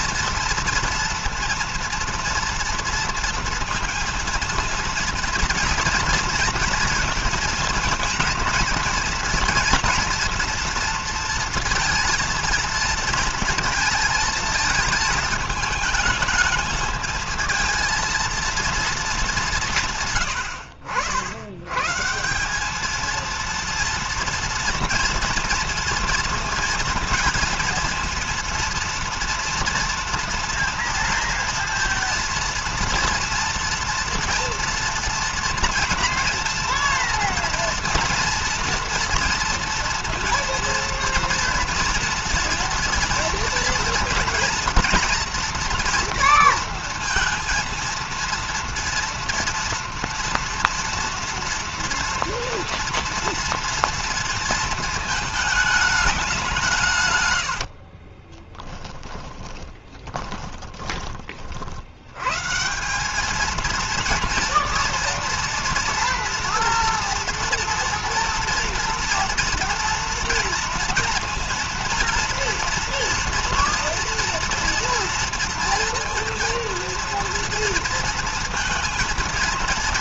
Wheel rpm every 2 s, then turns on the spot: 230, 230, 230, 230, 230, 230, 230, 220, 220, 230, 100, 180, 230, 230, 230, 230, 230, 230, 230, 230, 230, 230, 230, 230, 230, 230, 230, 230, 170, 40, 10, 140, 230, 230, 230, 230, 230, 230, 230, 230.
58-62